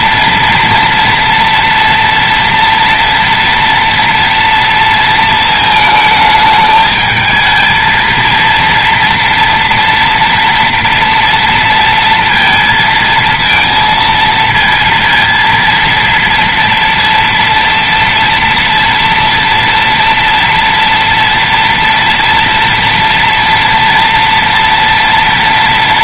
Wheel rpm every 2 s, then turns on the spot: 230, 230, 230, 220, 230, 240, 230, 230, 230, 230, 230, 230, 240.
none